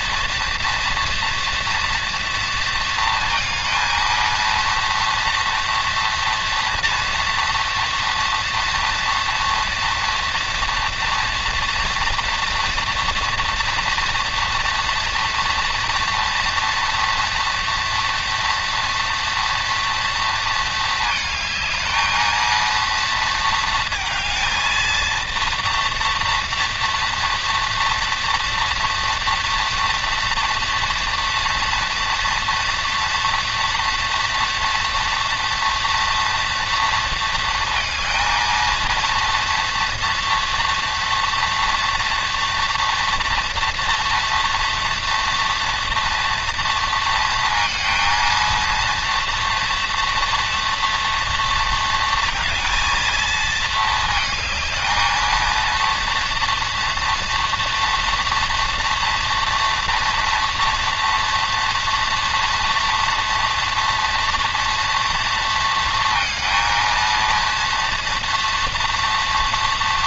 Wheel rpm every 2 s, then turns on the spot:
230, 230, 230, 230, 230, 230, 230, 230, 230, 230, 230, 230, 230, 230, 230, 240, 230, 230, 230, 230, 240, 230, 240, 230, 230, 230, 230, 220, 230, 230, 230, 230, 230, 230, 230.
none